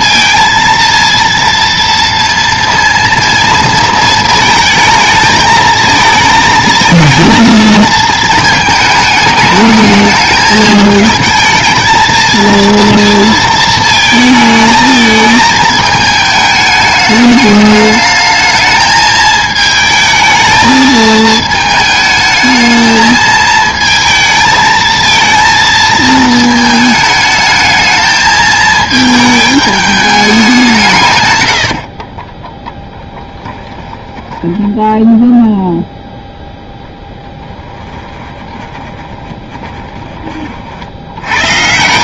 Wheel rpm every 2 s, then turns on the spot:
230, 230, 220, 220, 220, 220, 230, 220, 210, 220, 220, 220, 220, 220, 220, 190, 20, 10, 0, 20, 40.
32-36 38-40